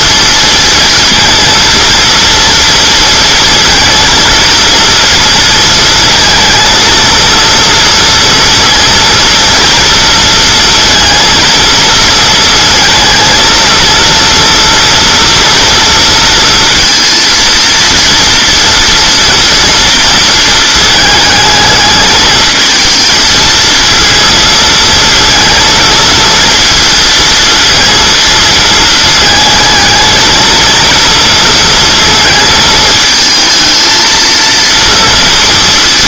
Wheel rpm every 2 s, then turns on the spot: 230, 230, 230, 230, 230, 230, 220, 230, 230, 230, 230, 220, 220, 230, 220, 230, 220, 230.
none